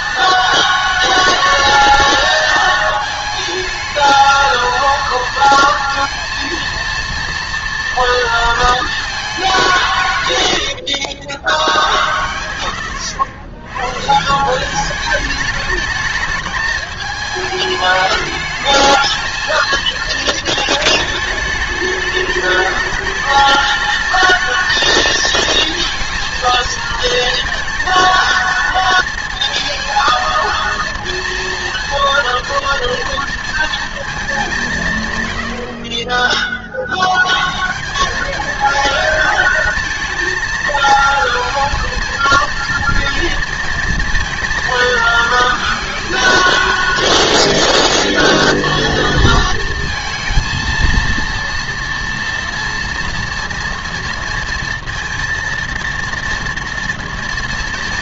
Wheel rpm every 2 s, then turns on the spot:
220, 220, 230, 230, 230, 100, 100, 180, 210, 220, 220, 210, 230, 230, 230, 230, 240, 180, 30, 220, 230, 230, 230, 220, 230, 230, 230, 230, 240.
10-12